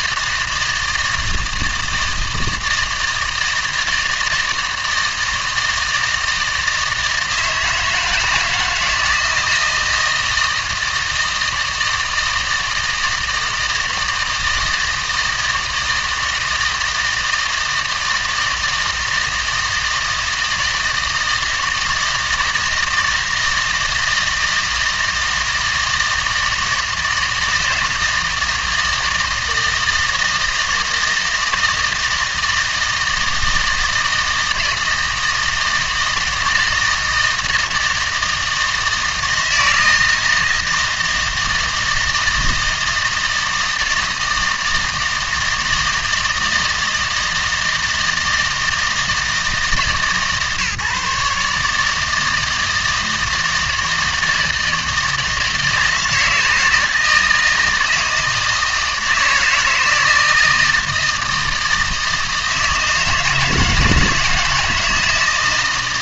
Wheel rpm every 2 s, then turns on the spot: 160, 160, 160, 160, 160, 160, 160, 160, 160, 160, 160, 160, 160, 160, 160, 160, 160, 170, 160, 160, 160, 160, 160, 160, 160, 150, 160, 160, 160, 160, 160, 160, 160.
none